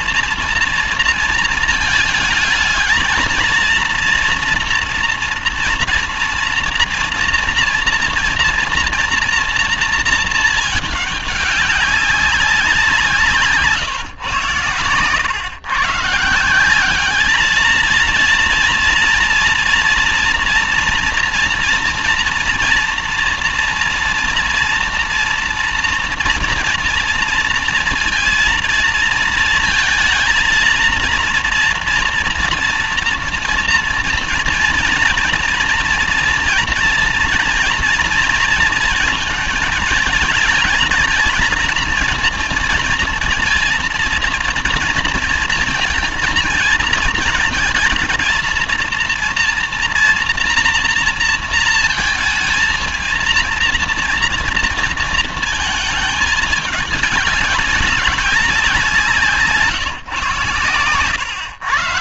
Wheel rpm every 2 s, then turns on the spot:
230, 220, 230, 230, 230, 210, 180, 120, 190, 230, 240, 230, 240, 230, 230, 230, 230, 240, 240, 230, 220, 230, 230, 220, 220, 230, 230, 230, 210, 180, 130.
none